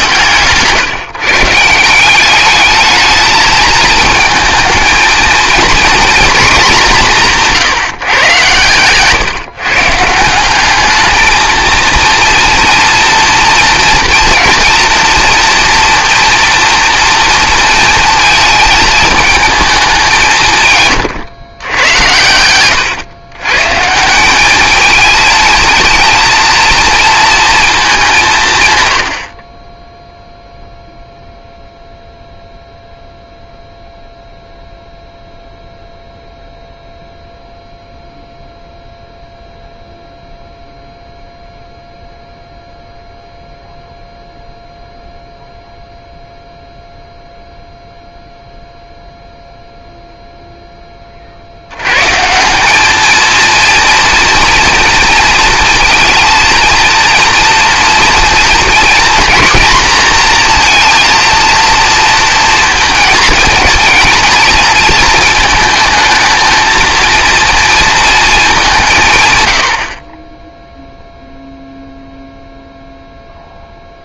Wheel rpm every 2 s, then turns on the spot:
140, 210, 220, 220, 120, 210, 240, 230, 240, 220, 140, 100, 220, 230, 110, 0, 0, 0, 0, 0, 0, 0, 0, 0, 0, 0, 200, 230, 230, 230, 230, 230, 230, 220, 180, 0, 0.
none